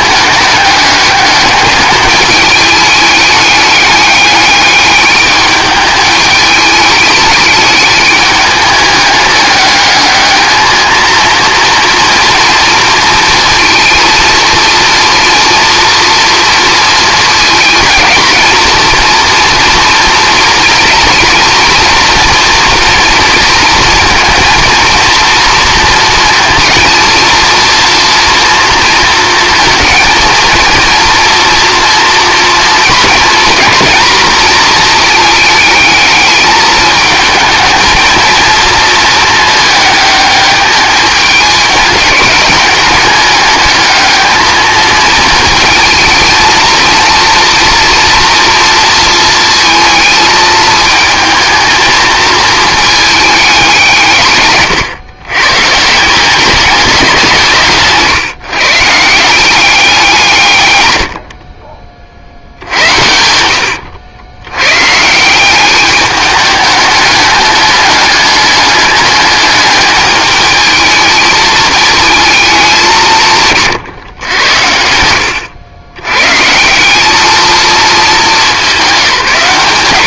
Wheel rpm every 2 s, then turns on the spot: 200, 210, 210, 210, 200, 220, 230, 230, 230, 230, 230, 230, 230, 230, 230, 230, 230, 220, 210, 220, 210, 210, 220, 230, 230, 220, 220, 130, 210, 150, 120, 80, 110, 210, 210, 210, 200, 80, 150, 190.
54-56 62-64